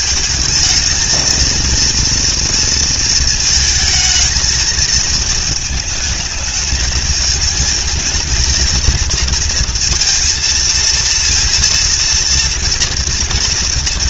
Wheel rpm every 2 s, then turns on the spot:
220, 230, 220, 220, 230, 230, 240.
none